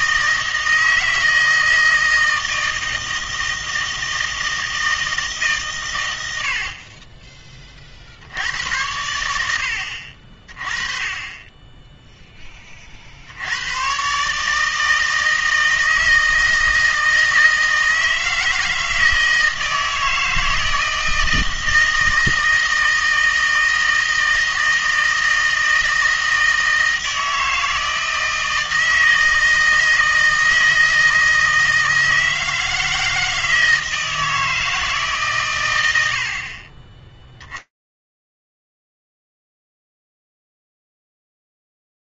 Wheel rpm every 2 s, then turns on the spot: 160, 160, 160, 50, 80, 30, 30, 160, 160, 160, 160, 160, 160, 160, 160, 160, 160, 160, 20, 0, 0.
none